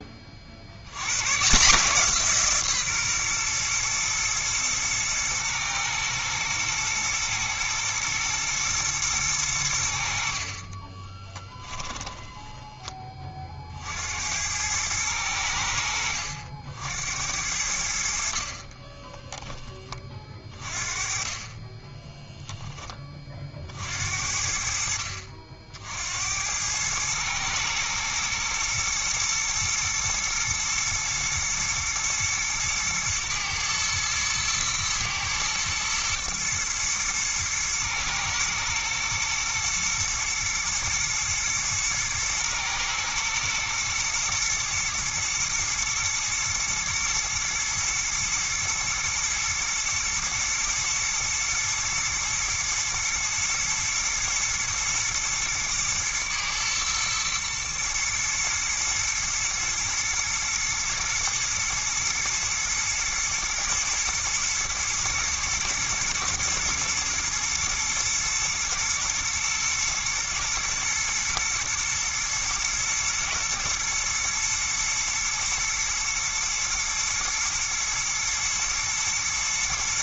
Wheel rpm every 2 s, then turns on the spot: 80, 140, 120, 110, 120, 30, 20, 100, 80, 30, 30, 10, 60, 100, 110, 110, 110, 110, 120, 120, 120, 110, 120, 120, 110, 120, 110, 120, 110, 110, 110, 120, 110, 120, 110, 120, 110, 110, 110, 110.
10-12 18-20